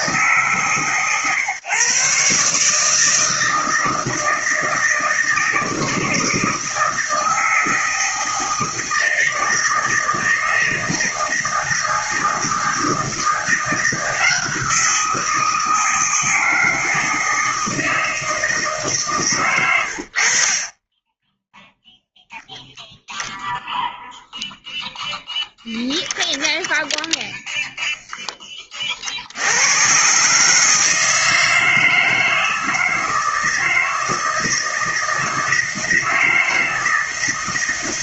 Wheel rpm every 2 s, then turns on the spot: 140, 150, 160, 160, 160, 160, 160, 170, 160, 150, 20, 0, 0, 0, 40, 160, 160, 160, 160.
none